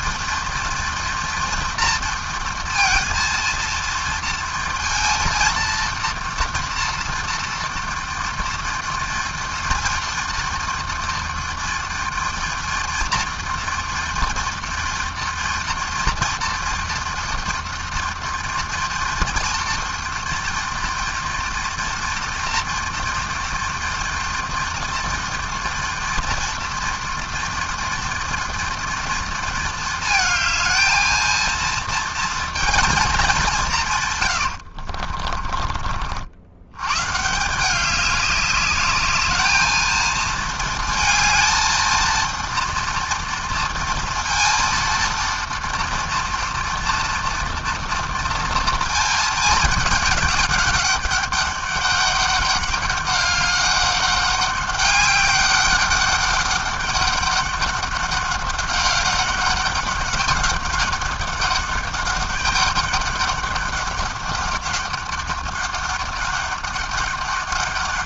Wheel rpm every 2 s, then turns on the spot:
230, 230, 230, 230, 230, 230, 230, 230, 230, 230, 230, 230, 230, 230, 230, 220, 200, 50, 150, 210, 230, 230, 230, 240, 220, 200, 200, 200, 200, 200, 200, 200, 200, 200.
34-36